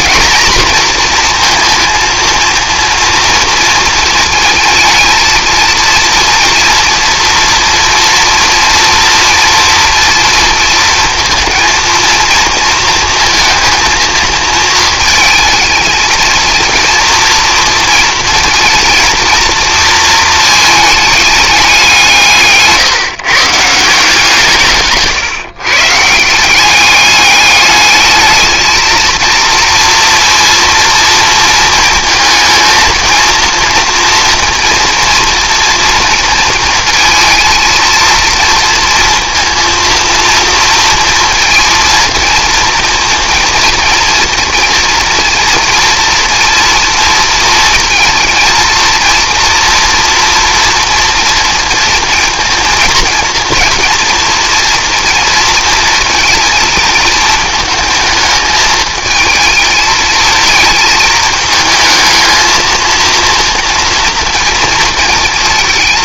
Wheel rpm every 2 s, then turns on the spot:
240, 230, 220, 230, 230, 230, 230, 230, 230, 230, 220, 150, 160, 190, 220, 230, 220, 230, 230, 230, 230, 230, 230, 230, 230, 230, 230, 230, 230, 220, 230, 220, 230.
none